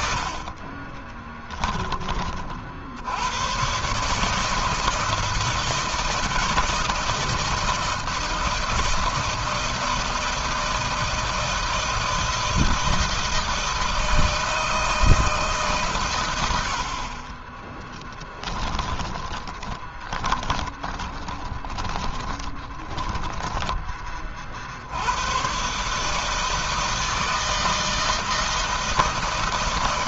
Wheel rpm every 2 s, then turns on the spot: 40, 40, 160, 160, 160, 160, 160, 160, 80, 20, 20, 20, 50, 160, 160.
0-2 18-24